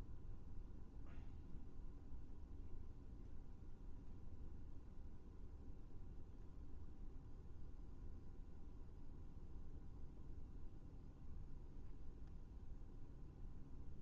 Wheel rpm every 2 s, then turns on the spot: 0, 0, 0, 0, 0, 0, 0.
none